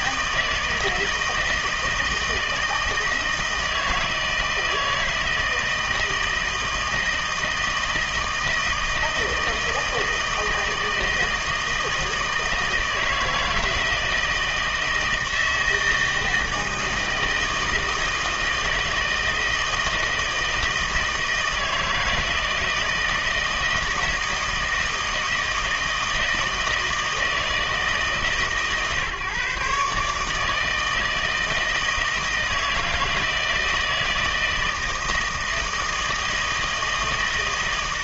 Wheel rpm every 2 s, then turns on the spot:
160, 160, 160, 160, 160, 160, 160, 160, 160, 160, 160, 160, 160, 160, 140, 160, 160, 160, 160.
none